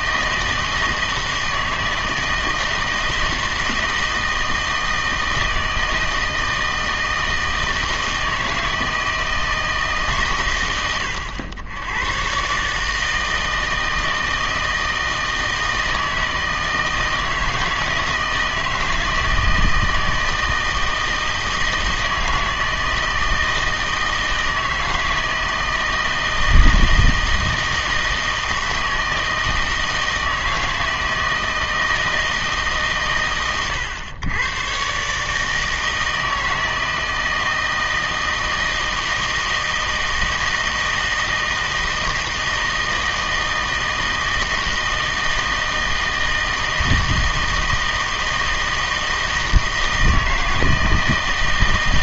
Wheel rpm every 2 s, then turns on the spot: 160, 160, 160, 160, 160, 80, 140, 160, 160, 160, 160, 160, 160, 160, 160, 160, 160, 120, 160, 160, 160, 160, 160, 160, 160, 160.
none